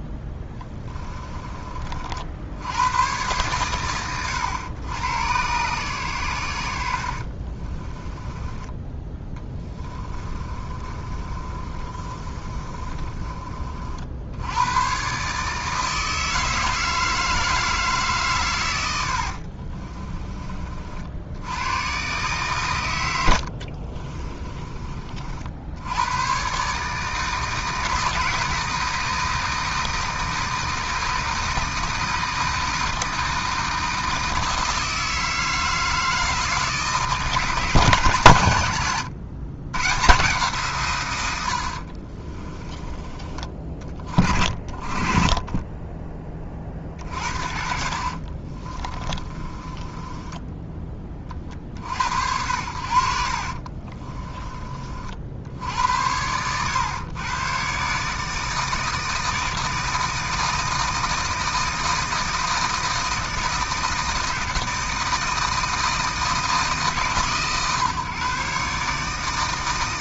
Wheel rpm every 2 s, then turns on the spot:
10, 60, 100, 70, 20, 30, 30, 120, 160, 90, 40, 130, 30, 140, 160, 160, 160, 160, 160, 90, 120, 20, 30, 40, 30, 0, 70, 40, 110, 160, 160, 160, 160, 140, 140.
0-2 6-8 10-14 18-20 42-44 48-50